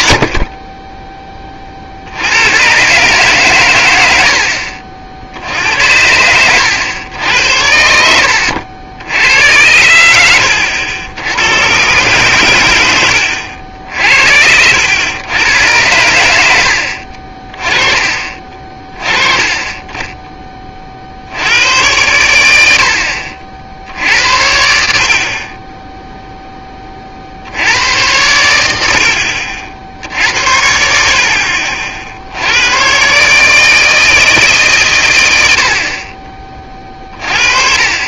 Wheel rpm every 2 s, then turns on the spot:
20, 120, 60, 100, 70, 80, 110, 80, 80, 30, 30, 90, 80, 20, 80, 60, 110, 130, 30.
none